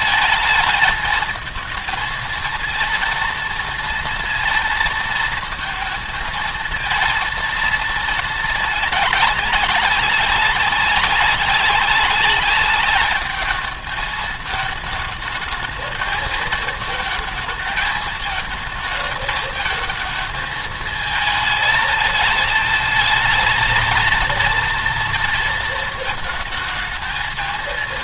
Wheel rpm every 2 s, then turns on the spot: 210, 230, 230, 220, 220, 190, 200, 210, 220, 220, 220, 220, 230, 220.
none